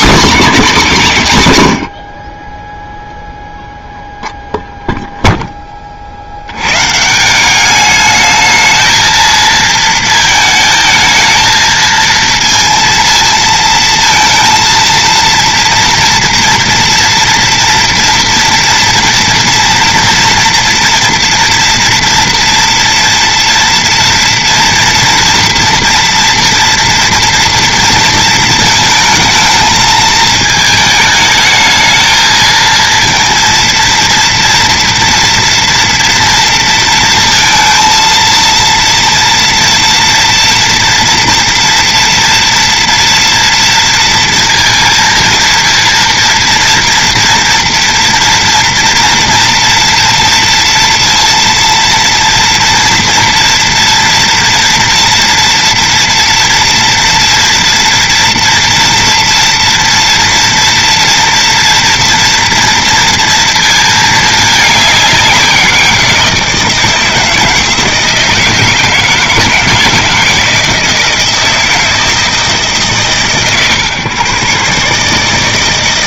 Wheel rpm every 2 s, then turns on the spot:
230, 10, 0, 100, 220, 220, 220, 230, 230, 240, 230, 230, 230, 230, 220, 220, 230, 230, 230, 230, 230, 230, 230, 230, 240, 230, 230, 230, 230, 230, 230, 230, 210, 160, 160, 160, 150, 130.
none